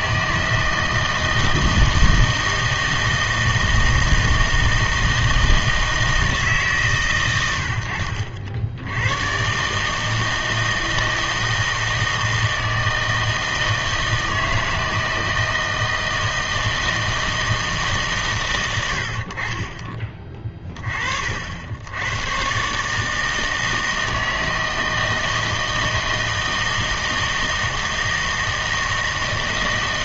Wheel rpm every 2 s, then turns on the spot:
160, 160, 160, 150, 70, 160, 160, 160, 160, 100, 30, 130, 160, 160, 160.
none